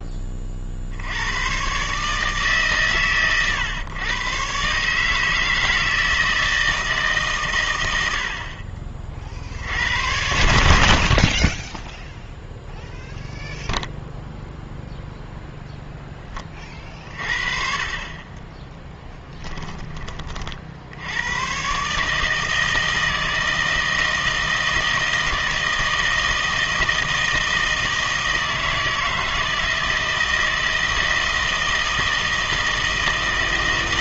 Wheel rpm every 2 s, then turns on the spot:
50, 140, 140, 160, 40, 60, 0, 0, 40, 20, 60, 160, 160, 160, 160, 160, 160.
18-20